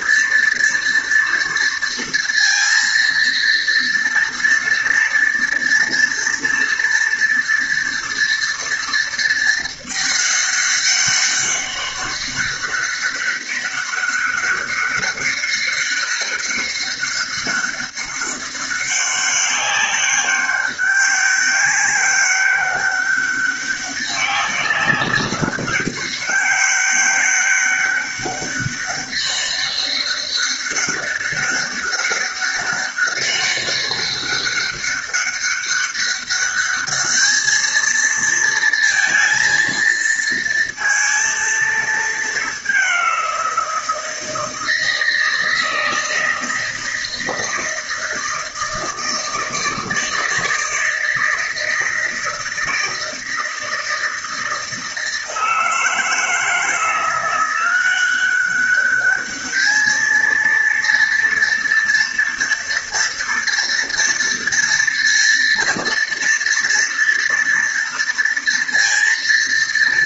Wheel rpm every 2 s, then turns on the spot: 230, 230, 230, 230, 230, 200, 200, 200, 200, 200, 200, 200, 200, 200, 200, 200, 200, 200, 210, 230, 230, 190, 160, 160, 160, 160, 160, 160, 170, 200, 230, 230, 230, 230, 230.
none